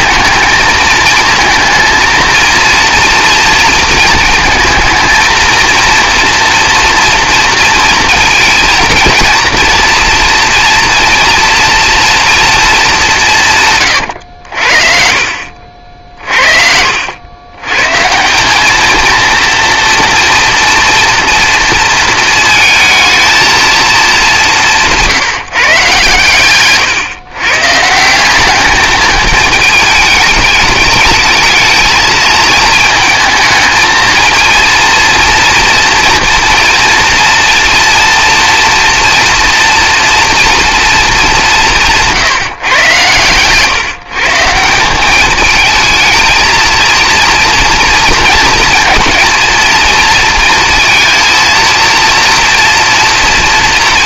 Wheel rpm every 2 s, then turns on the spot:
220, 230, 220, 230, 230, 230, 230, 70, 60, 210, 230, 220, 180, 120, 210, 210, 220, 230, 240, 230, 230, 140, 160, 230, 230, 230, 230.
16-18